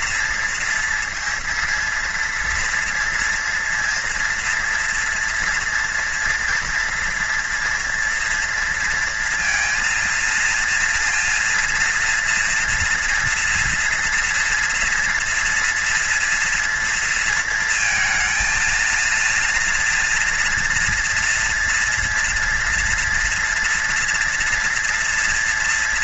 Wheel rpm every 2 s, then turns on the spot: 230, 240, 230, 230, 230, 230, 230, 230, 230, 230, 230, 230, 230.
none